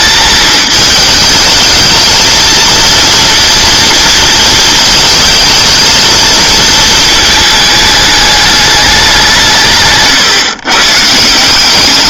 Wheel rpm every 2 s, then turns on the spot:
220, 230, 220, 220, 210, 130.
none